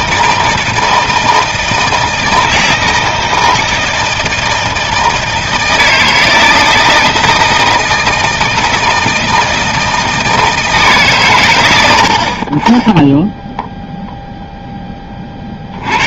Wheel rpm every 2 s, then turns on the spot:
160, 160, 160, 160, 160, 160, 40, 0.
none